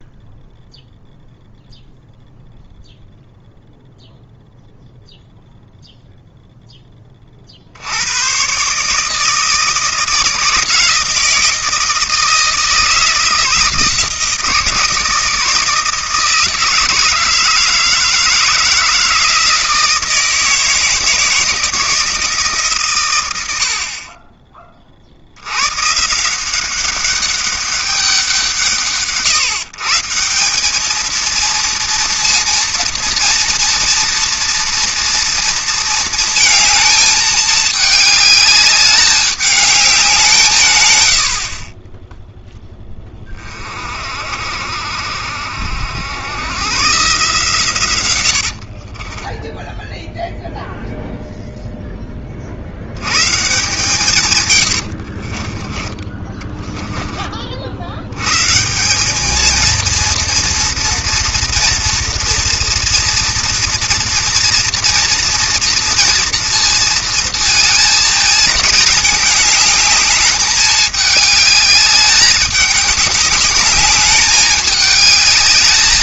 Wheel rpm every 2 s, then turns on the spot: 0, 0, 0, 0, 130, 160, 160, 160, 160, 170, 160, 140, 30, 180, 160, 190, 230, 230, 220, 210, 140, 10, 60, 120, 60, 0, 70, 100, 20, 150, 230, 230, 230, 230, 220, 210, 200, 210.
48-50 54-58